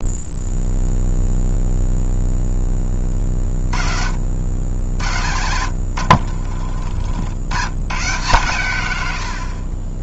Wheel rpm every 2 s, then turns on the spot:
0, 20, 70, 50, 100.
none